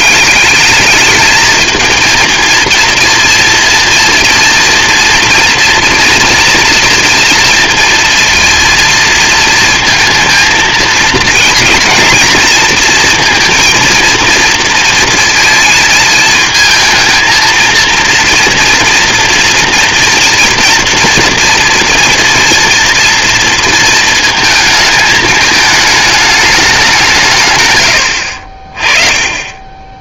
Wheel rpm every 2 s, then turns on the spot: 210, 230, 230, 230, 230, 220, 230, 230, 220, 230, 230, 240, 220, 200, 30.
none